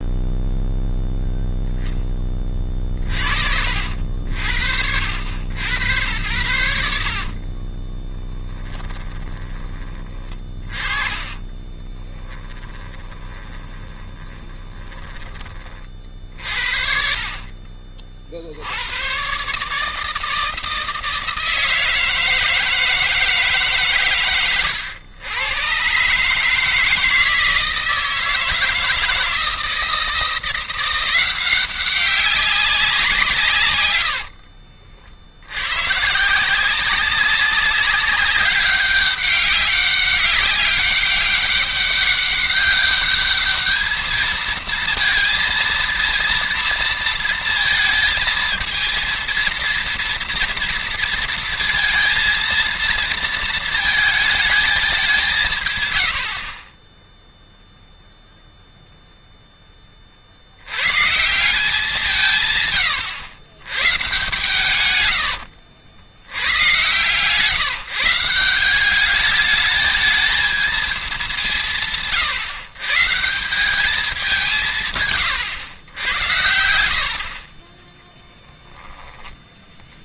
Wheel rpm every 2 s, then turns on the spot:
0, 30, 70, 80, 20, 30, 20, 20, 60, 90, 160, 160, 110, 160, 160, 180, 180, 60, 190, 200, 200, 200, 230, 230, 230, 230, 230, 200, 20, 0, 100, 120, 110, 130, 190, 220, 140, 160, 80, 10.
8-16 56-58